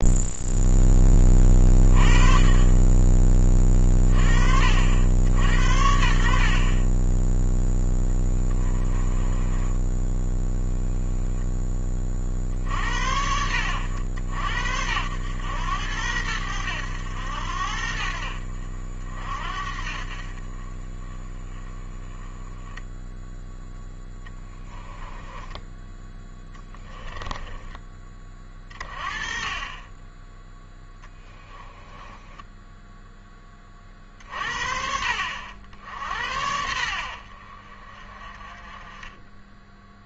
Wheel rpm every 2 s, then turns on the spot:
10, 30, 60, 30, 20, 10, 60, 80, 90, 60, 20, 10, 10, 10, 30, 10, 10, 60, 70, 20.
8-12 24-28 30-34